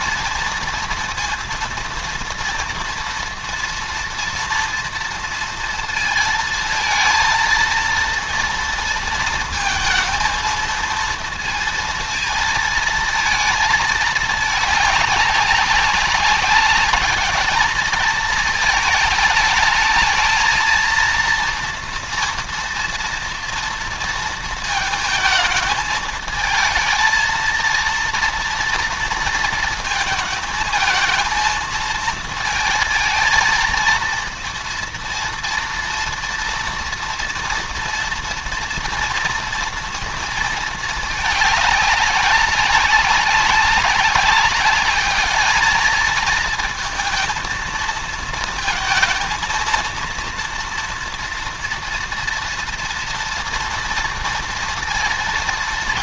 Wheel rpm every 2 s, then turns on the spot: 230, 230, 230, 220, 230, 230, 230, 210, 190, 220, 220, 230, 230, 220, 230, 230, 230, 230, 230, 240, 220, 190, 200, 230, 220, 230, 230, 230.
none